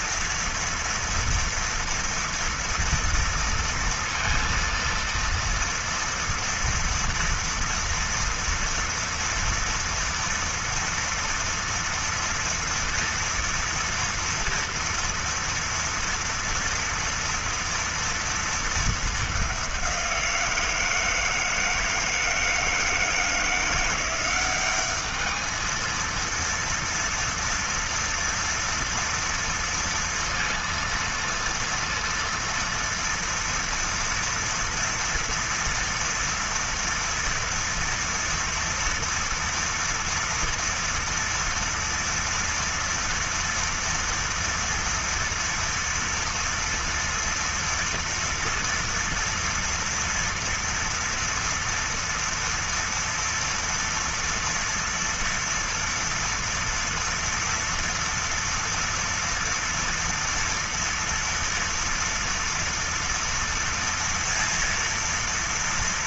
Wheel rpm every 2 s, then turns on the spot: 230, 230, 230, 230, 230, 230, 230, 230, 230, 220, 170, 160, 200, 230, 230, 230, 230, 230, 230, 230, 230, 230, 230, 230, 230, 230, 230, 230, 230, 230, 230, 240, 230.
none